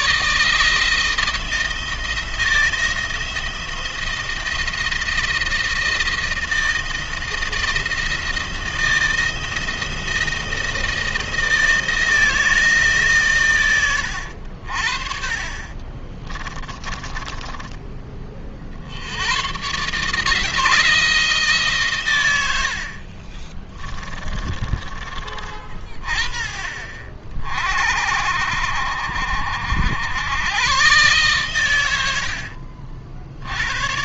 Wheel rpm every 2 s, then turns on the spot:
160, 170, 170, 170, 170, 170, 150, 60, 20, 70, 160, 60, 20, 50, 60, 120, 60.
16-18